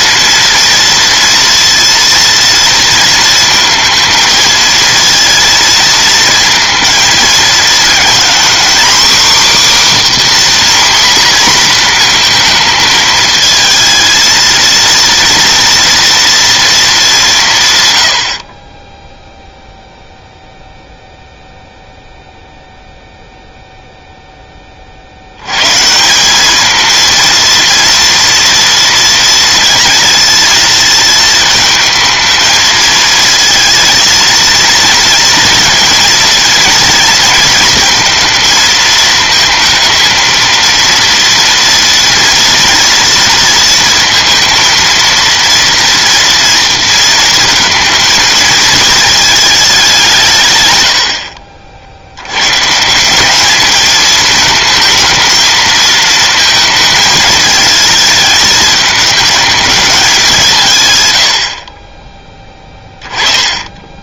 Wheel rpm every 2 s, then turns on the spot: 230, 230, 220, 230, 250, 270, 230, 230, 230, 30, 0, 0, 20, 210, 230, 220, 230, 230, 230, 220, 230, 230, 230, 230, 230, 120, 130, 220, 220, 220, 170, 10.
none